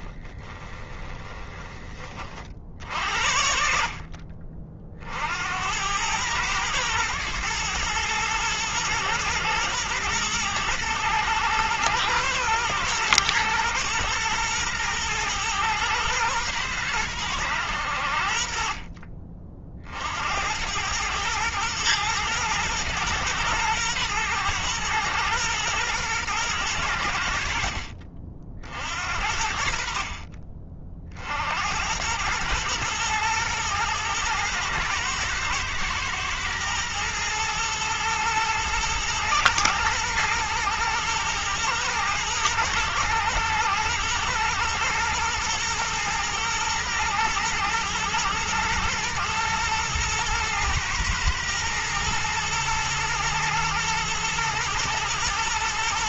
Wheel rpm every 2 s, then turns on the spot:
20, 60, 50, 110, 110, 120, 110, 110, 110, 40, 110, 110, 120, 90, 60, 40, 110, 120, 110, 110, 120, 120, 120, 110, 110, 110, 110, 120.
0-2